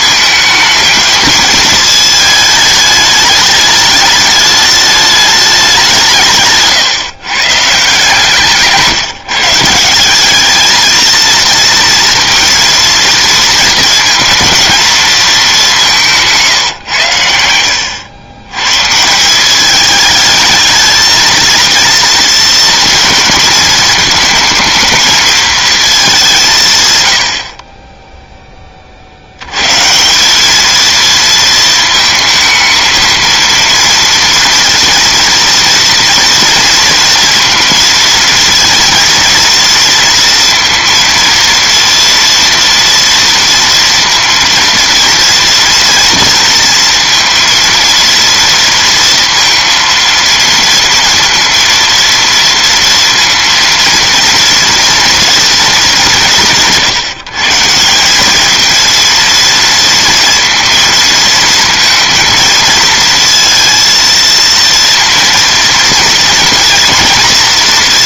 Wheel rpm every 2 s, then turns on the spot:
220, 220, 210, 150, 160, 220, 230, 230, 140, 130, 220, 230, 220, 150, 20, 220, 220, 230, 230, 230, 230, 230, 230, 230, 230, 230, 230, 230, 140, 230, 230, 230, 230, 240.
6-8